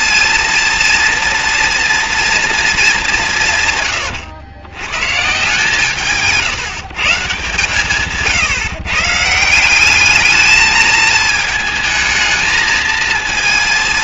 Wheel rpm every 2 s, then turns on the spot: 230, 210, 110, 160, 140, 220, 220.
none